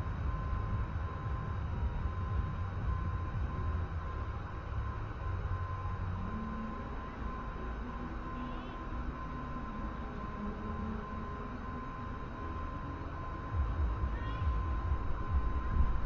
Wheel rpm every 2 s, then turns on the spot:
0, 0, 0, 0, 0, 0, 0, 0.
none